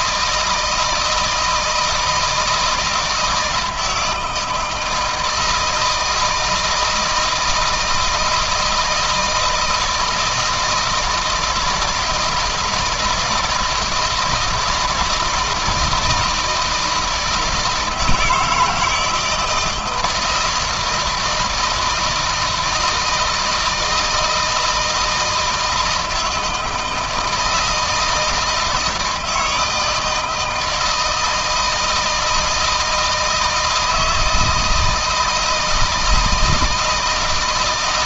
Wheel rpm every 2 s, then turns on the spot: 160, 160, 160, 160, 160, 160, 160, 160, 170, 160, 160, 160, 160, 160, 160, 160, 160, 160, 160.
none